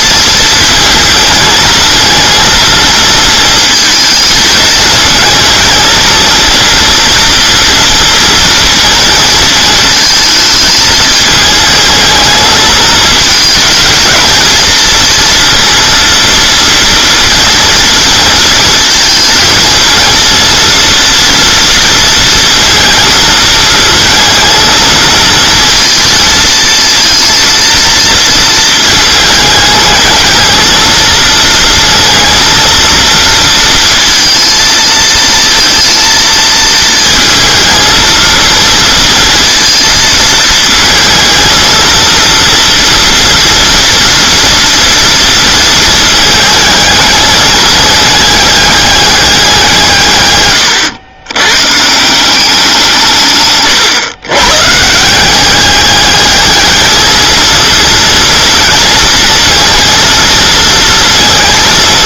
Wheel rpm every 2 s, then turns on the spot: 220, 230, 220, 230, 230, 220, 220, 230, 230, 220, 230, 230, 220, 220, 220, 230, 230, 230, 230, 230, 220, 230, 230, 220, 200, 110, 170, 150, 220, 230, 230.
none